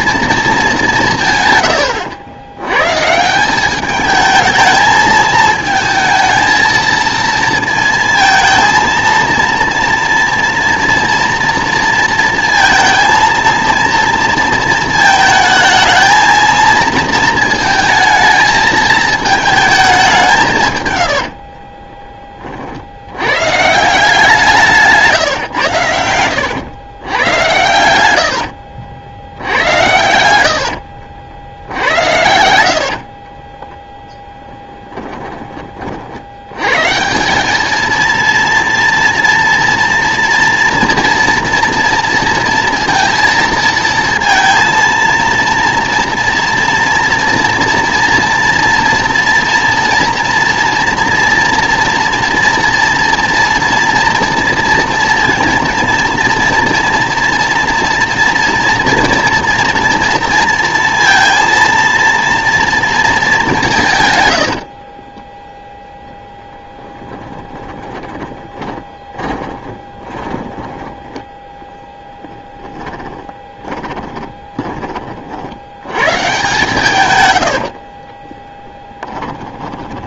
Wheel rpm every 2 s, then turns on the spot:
200, 110, 220, 230, 230, 230, 230, 220, 230, 220, 120, 60, 160, 110, 80, 80, 70, 10, 120, 230, 230, 230, 230, 230, 230, 230, 230, 230, 230, 230, 230, 230, 70, 10, 20, 10, 10, 20, 130, 10.
28-36 64-74 78-80